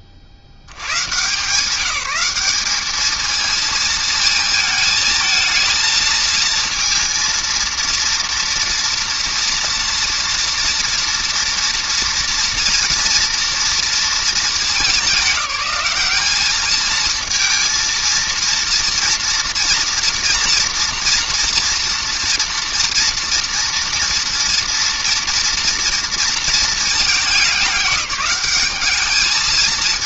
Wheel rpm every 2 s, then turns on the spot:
10, 170, 230, 220, 230, 230, 230, 230, 190, 230, 230, 230, 230, 230, 190.
none